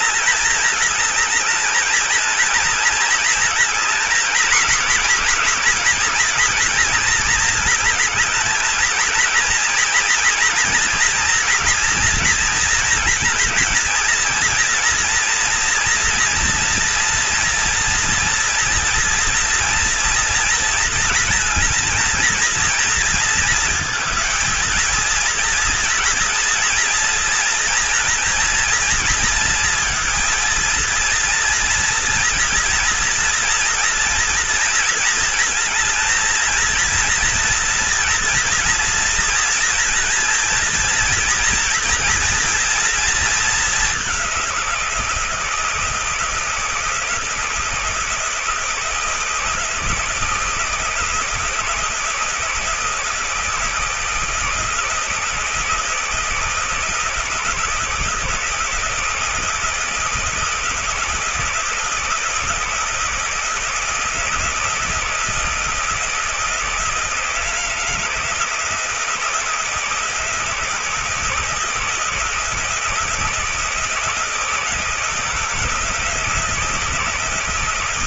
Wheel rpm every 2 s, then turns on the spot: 220, 220, 230, 220, 230, 230, 220, 230, 240, 230, 230, 230, 230, 230, 230, 240, 230, 220, 230, 230, 230, 210, 170, 170, 160, 160, 160, 160, 170, 160, 160, 160, 160, 160, 160, 160, 160, 160, 160.
none